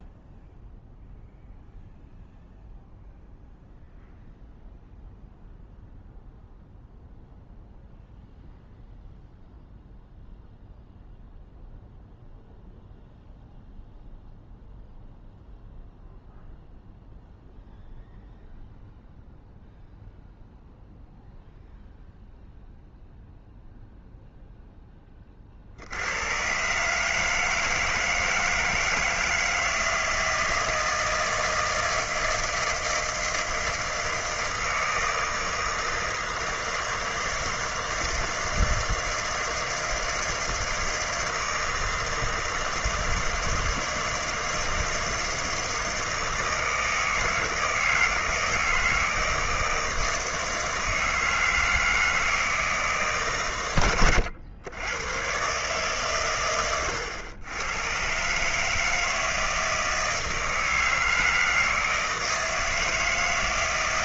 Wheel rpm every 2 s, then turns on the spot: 0, 0, 0, 0, 0, 0, 0, 0, 0, 0, 0, 0, 0, 130, 160, 160, 160, 160, 160, 160, 160, 160, 160, 160, 160, 160, 160, 90, 110, 150, 160, 160.
none